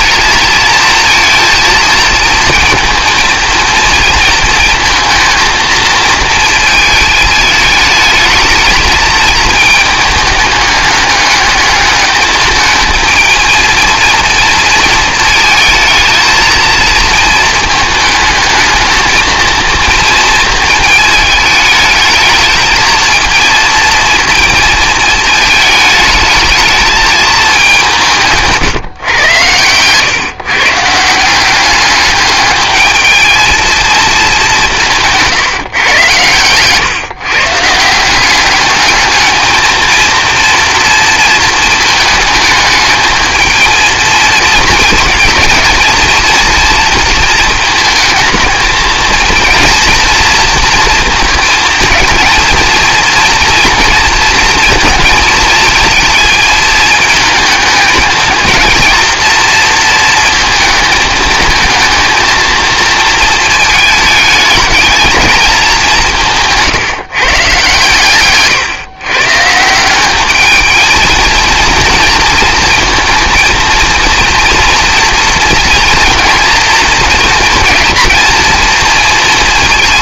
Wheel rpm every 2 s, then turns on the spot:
230, 230, 230, 220, 220, 210, 220, 230, 220, 220, 220, 220, 220, 220, 140, 150, 210, 180, 130, 210, 230, 220, 230, 230, 220, 230, 230, 230, 220, 230, 220, 230, 220, 150, 130, 220, 230, 230, 230, 230.
none